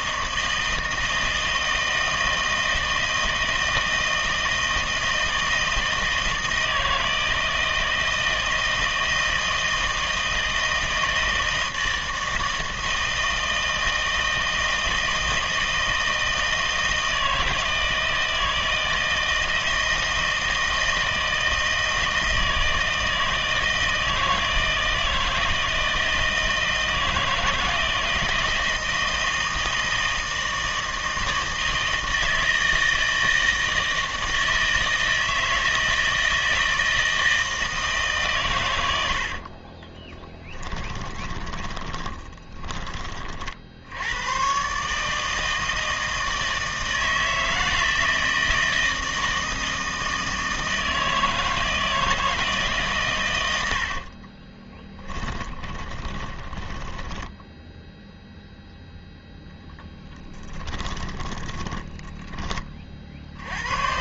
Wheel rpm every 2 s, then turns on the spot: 160, 160, 160, 160, 160, 160, 160, 160, 160, 160, 160, 160, 160, 160, 170, 160, 160, 160, 160, 110, 20, 30, 130, 160, 160, 160, 150, 20, 20, 0, 10, 20.
40-44 54-58 60-62